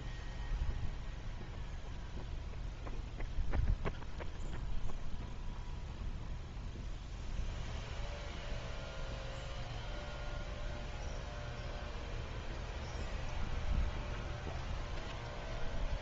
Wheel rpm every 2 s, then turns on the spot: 0, 0, 0, 0, 0, 0, 0, 0.
none